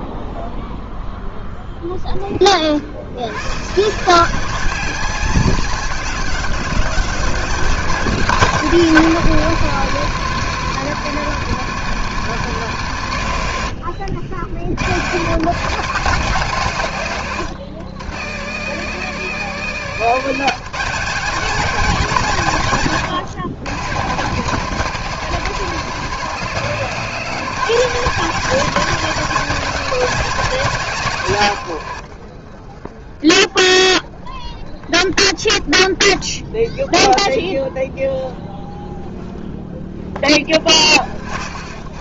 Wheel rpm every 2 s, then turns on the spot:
0, 90, 190, 200, 250, 220, 170, 140, 140, 190, 230, 160, 200, 200, 250, 190, 20, 20, 10, 10, 40.
none